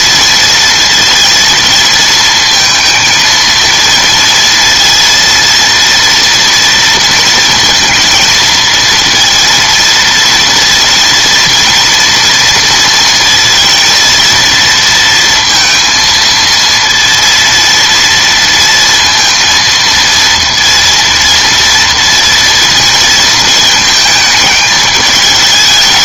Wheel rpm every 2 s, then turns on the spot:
230, 220, 230, 230, 230, 230, 230, 230, 230, 230, 230, 230, 220.
none